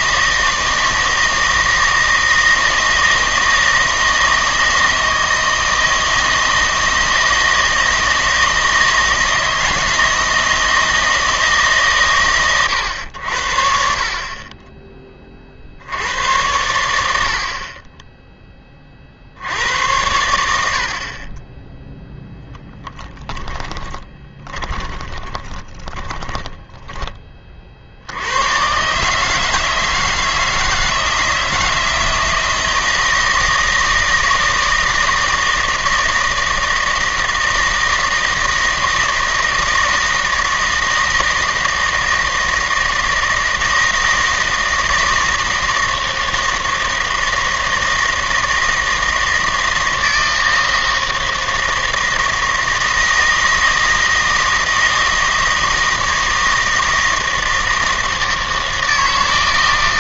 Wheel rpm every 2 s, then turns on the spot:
160, 160, 160, 160, 160, 160, 110, 30, 100, 20, 70, 20, 20, 10, 120, 160, 170, 160, 160, 160, 160, 160, 160, 160, 160, 160, 160, 160, 160, 160.
22-28